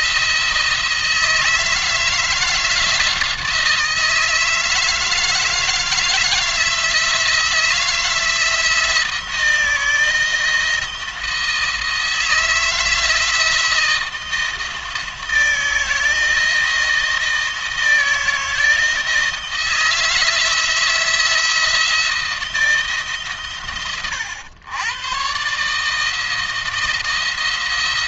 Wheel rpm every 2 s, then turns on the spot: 160, 160, 160, 160, 170, 160, 160, 160, 160, 160, 160, 160, 100, 160.
none